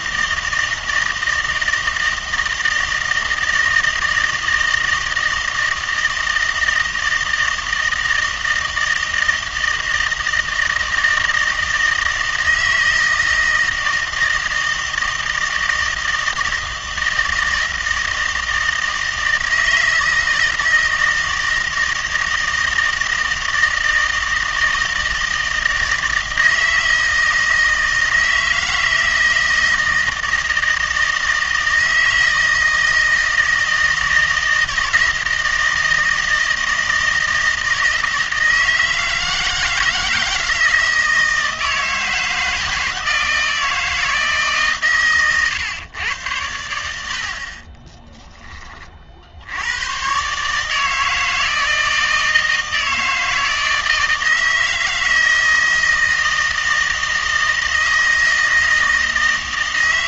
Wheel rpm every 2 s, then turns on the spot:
160, 160, 160, 160, 160, 160, 160, 160, 160, 160, 160, 160, 160, 160, 160, 160, 160, 160, 160, 160, 160, 160, 140, 90, 20, 150, 160, 160, 160, 160.
none